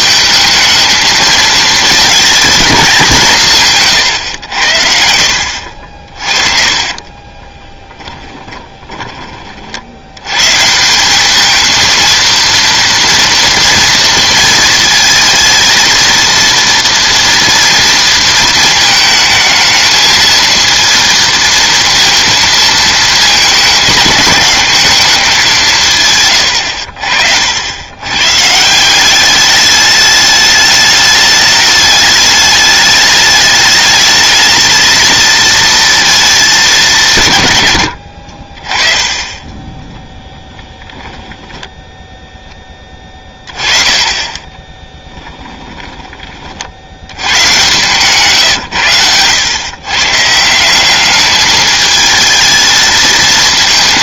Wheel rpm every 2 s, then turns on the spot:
220, 190, 70, 30, 20, 170, 230, 230, 230, 220, 230, 220, 210, 70, 180, 210, 210, 220, 180, 30, 10, 10, 10, 80, 100, 190, 220.
6-10 44-46